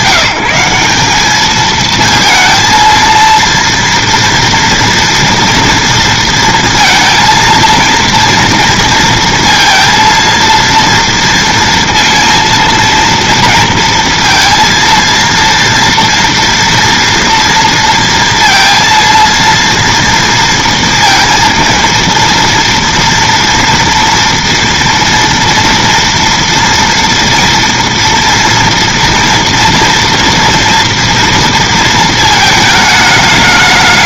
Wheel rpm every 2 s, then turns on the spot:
190, 230, 230, 230, 230, 230, 230, 230, 230, 230, 230, 230, 230, 230, 230, 230, 220.
none